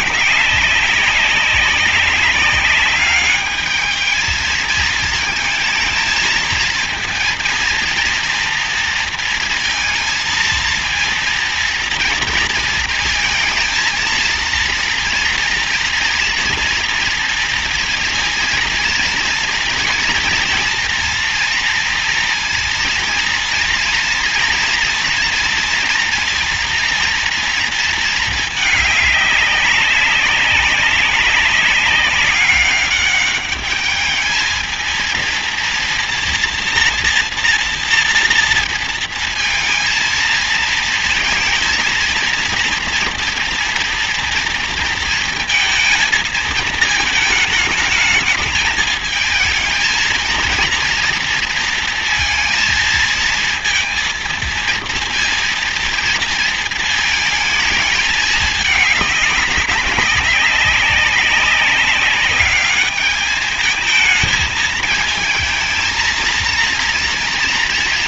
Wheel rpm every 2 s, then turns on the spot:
200, 200, 220, 220, 230, 230, 230, 230, 230, 230, 230, 230, 240, 230, 220, 190, 200, 220, 230, 230, 230, 230, 230, 230, 220, 230, 220, 230, 230, 210, 190, 200, 220, 230.
none